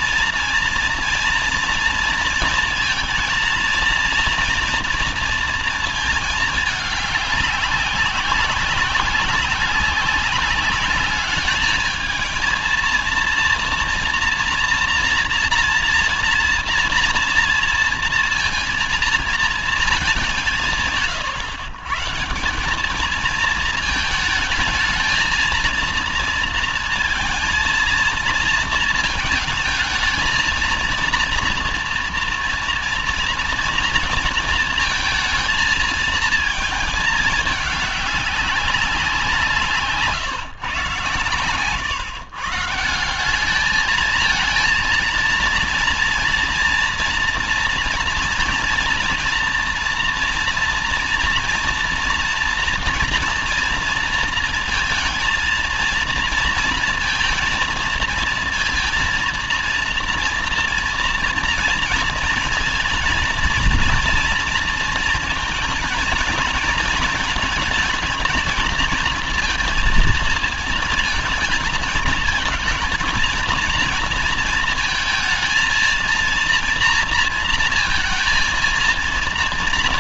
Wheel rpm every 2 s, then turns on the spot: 230, 230, 230, 200, 190, 210, 230, 230, 230, 230, 120, 220, 220, 220, 220, 230, 230, 230, 220, 180, 140, 190, 230, 230, 230, 230, 230, 230, 230, 230, 230, 230, 220, 220, 230, 230, 230, 220, 230, 230.
none